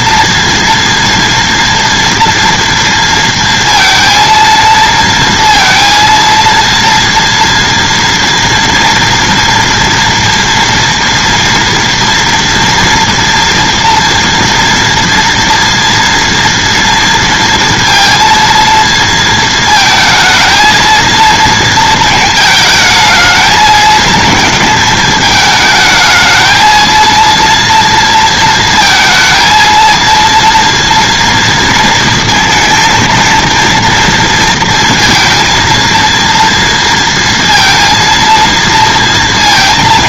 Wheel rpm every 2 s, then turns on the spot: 230, 230, 230, 230, 230, 230, 230, 230, 230, 230, 220, 220, 220, 220, 230, 230, 230, 230, 230, 230.
none